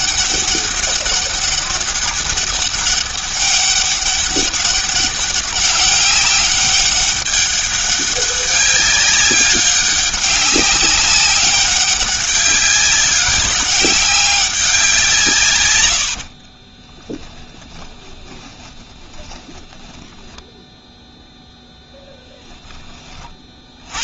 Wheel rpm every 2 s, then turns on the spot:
200, 200, 200, 200, 200, 200, 190, 190, 40, 20, 0, 10.
16-20